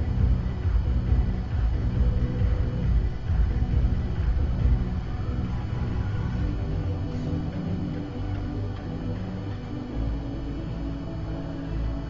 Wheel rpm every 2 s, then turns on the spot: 0, 0, 0, 0, 0, 0.
none